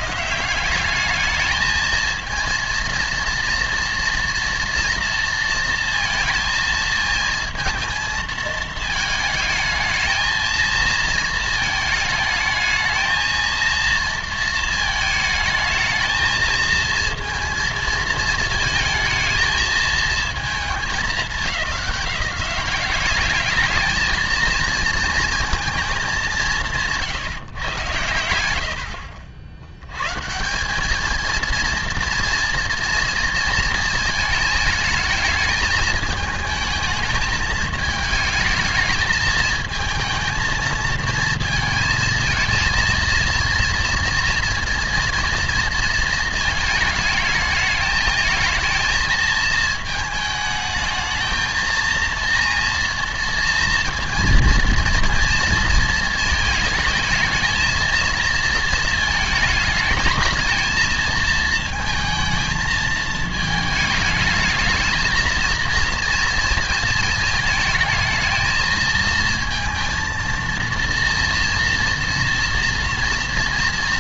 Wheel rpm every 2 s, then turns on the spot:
130, 230, 230, 220, 220, 220, 220, 230, 220, 220, 210, 190, 230, 160, 80, 190, 240, 220, 220, 220, 230, 230, 230, 220, 220, 220, 230, 240, 220, 230, 220, 220, 220, 230, 220, 230, 230.
none